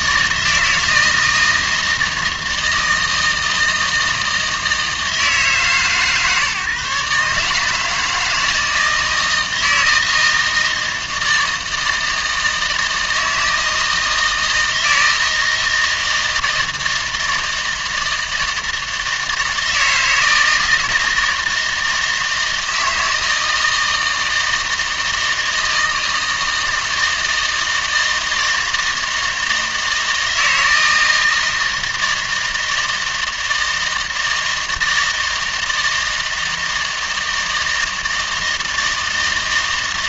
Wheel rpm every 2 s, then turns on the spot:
160, 160, 160, 140, 160, 160, 160, 160, 160, 160, 160, 160, 160, 160, 160, 160, 160, 160, 160, 160.
none